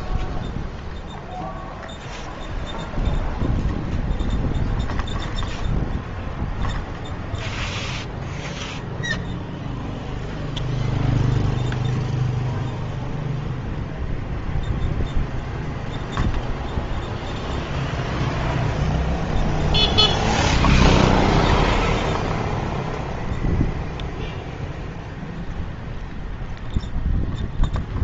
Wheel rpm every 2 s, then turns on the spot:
0, 0, 0, 0, 0, 0, 0, 0, 0, 0, 0, 0, 0, 0.
none